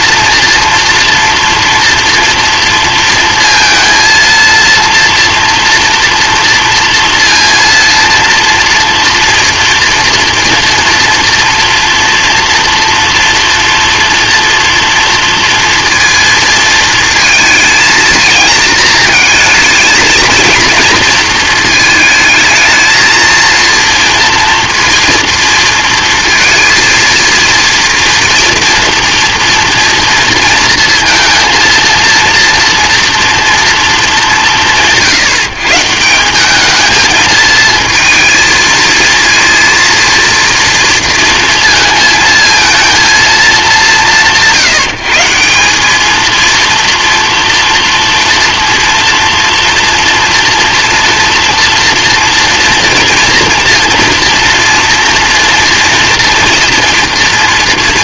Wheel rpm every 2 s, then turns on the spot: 230, 230, 230, 230, 230, 240, 230, 230, 220, 220, 230, 220, 230, 230, 230, 230, 230, 160, 220, 220, 230, 220, 160, 230, 230, 230, 240, 230, 240.
none